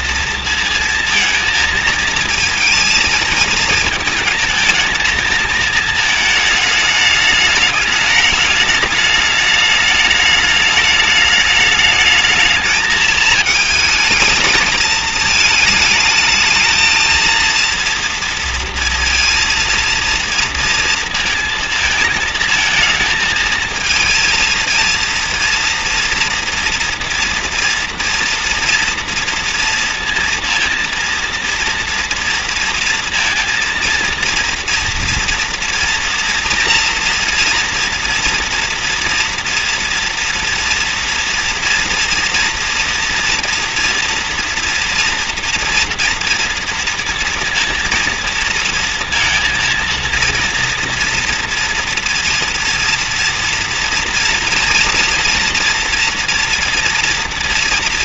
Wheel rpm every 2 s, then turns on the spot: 230, 220, 220, 210, 210, 210, 220, 220, 220, 230, 230, 220, 230, 230, 230, 220, 230, 240, 230, 240, 230, 230, 230, 230, 230, 230, 230, 240, 240.
none